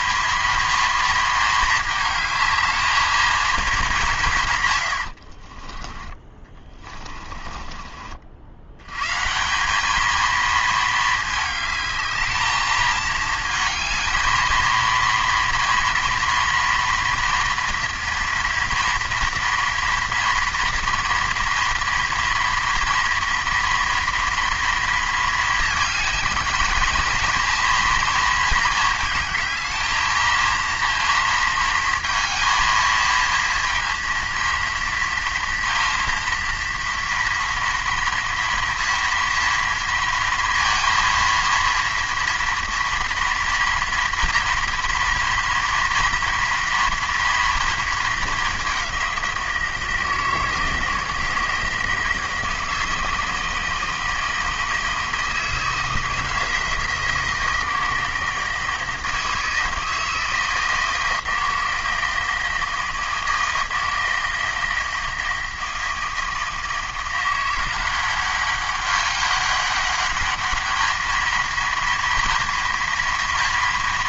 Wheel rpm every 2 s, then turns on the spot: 230, 220, 130, 20, 80, 220, 220, 230, 230, 230, 230, 230, 230, 220, 220, 230, 230, 230, 230, 230, 230, 230, 230, 230, 200, 160, 160, 160, 170, 160, 160, 160, 160, 160, 200, 210, 240.
6-8